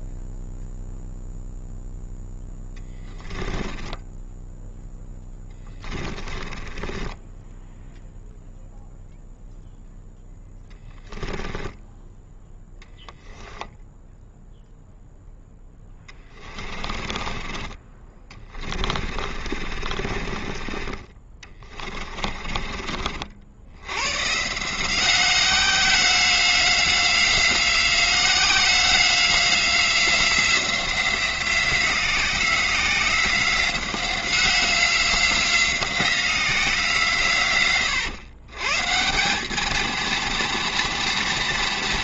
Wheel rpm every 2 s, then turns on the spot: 0, 10, 10, 10, 0, 10, 0, 10, 30, 40, 30, 50, 170, 180, 180, 180, 180, 180, 160, 160, 230.
2-4 6-8 10-12 16-20